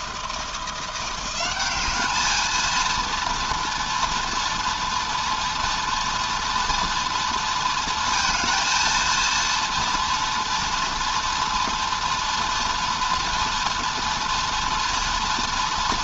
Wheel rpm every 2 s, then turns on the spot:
190, 230, 230, 230, 230, 230, 240, 230.
none